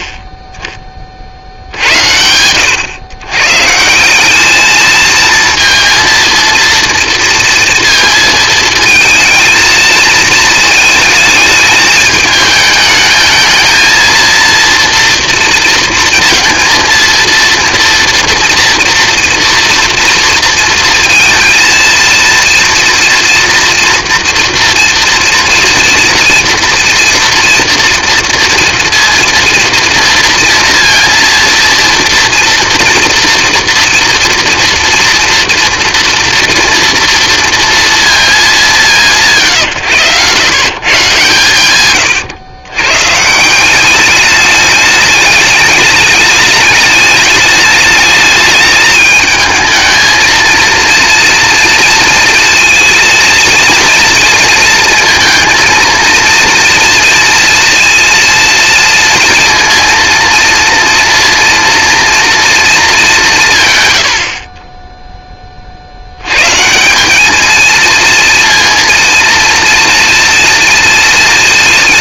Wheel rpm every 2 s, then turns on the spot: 10, 110, 220, 230, 230, 220, 220, 230, 230, 230, 230, 230, 230, 240, 230, 230, 230, 230, 230, 190, 130, 120, 210, 210, 210, 230, 230, 230, 230, 230, 230, 220, 30, 180, 230, 230.
none